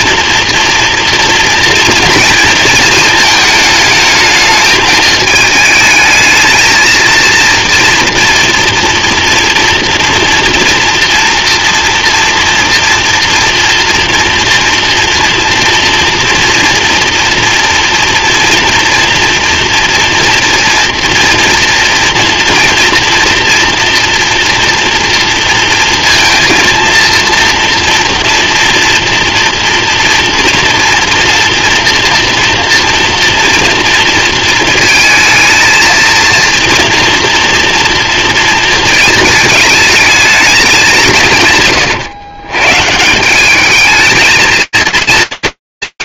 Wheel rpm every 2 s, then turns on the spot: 230, 230, 210, 220, 240, 230, 230, 230, 230, 230, 230, 230, 230, 230, 230, 230, 230, 230, 230, 230, 210, 130, 220.
none